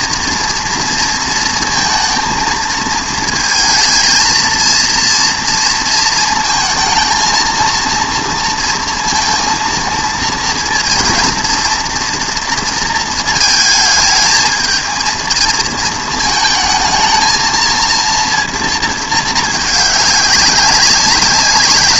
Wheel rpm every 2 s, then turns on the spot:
230, 230, 230, 220, 230, 230, 230, 220, 220, 230, 190.
none